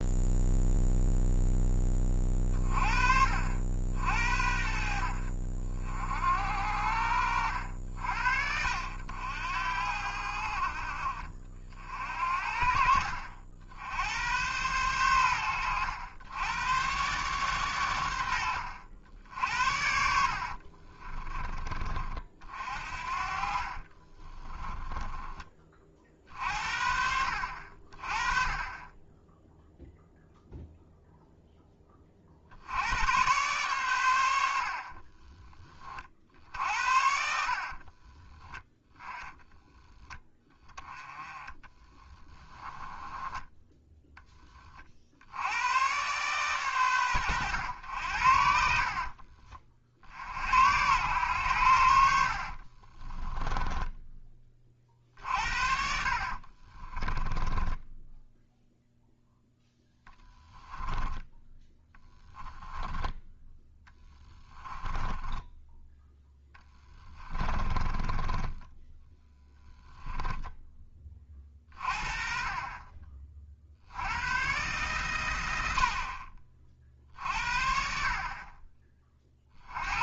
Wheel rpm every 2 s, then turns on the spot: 0, 40, 60, 70, 70, 50, 50, 100, 120, 80, 40, 60, 10, 50, 10, 0, 80, 50, 70, 10, 10, 10, 40, 120, 50, 90, 30, 40, 30, 0, 10, 10, 10, 10, 20, 20, 30, 130, 50, 30.
20-22 24-26 34-36 42-44 48-50 52-58 60-70